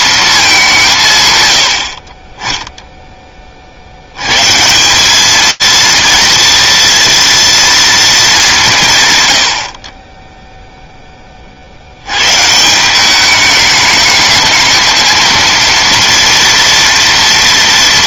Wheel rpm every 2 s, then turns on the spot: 150, 10, 190, 230, 140, 10, 190, 220, 230.
none